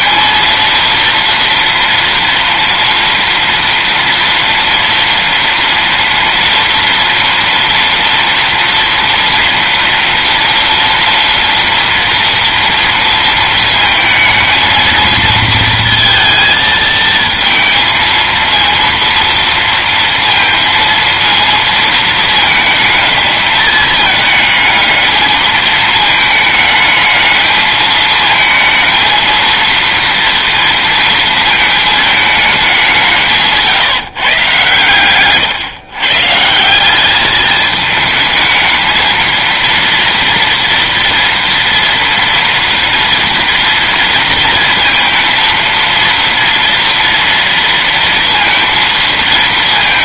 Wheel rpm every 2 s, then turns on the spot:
230, 230, 230, 230, 230, 230, 230, 230, 220, 230, 230, 220, 220, 220, 220, 230, 200, 130, 170, 220, 230, 230, 230, 230, 230.
none